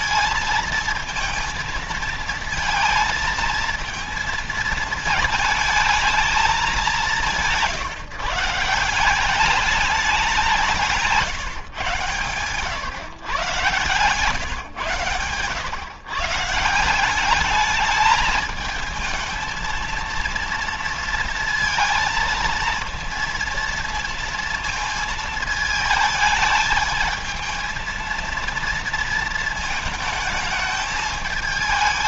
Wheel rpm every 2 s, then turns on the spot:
230, 230, 220, 200, 170, 170, 120, 120, 160, 220, 230, 230, 230, 220, 230, 220.
none